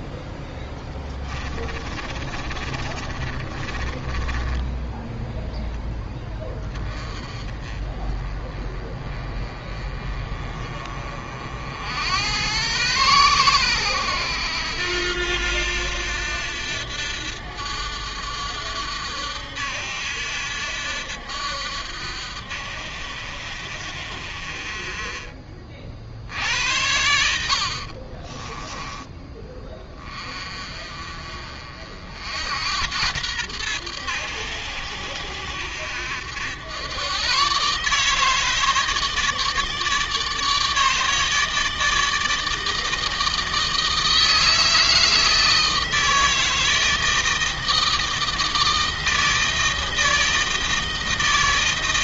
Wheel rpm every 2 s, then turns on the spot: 20, 30, 10, 10, 20, 40, 100, 80, 80, 70, 70, 60, 40, 70, 10, 30, 80, 80, 90, 150, 150, 160, 160, 160, 160, 160.
0-6